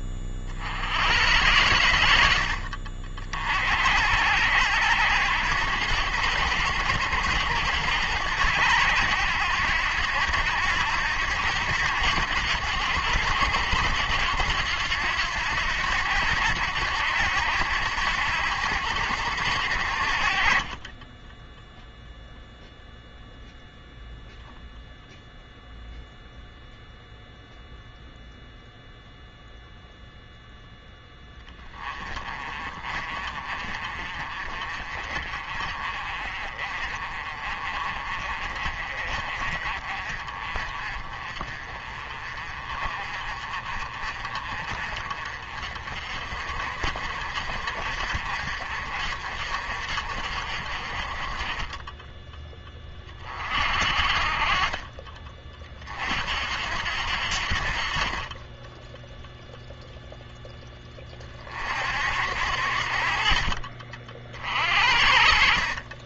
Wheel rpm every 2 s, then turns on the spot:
80, 60, 80, 90, 90, 90, 90, 90, 80, 80, 30, 0, 0, 0, 0, 0, 30, 40, 40, 40, 30, 40, 40, 50, 50, 40, 20, 30, 60, 10, 20, 60, 60.
none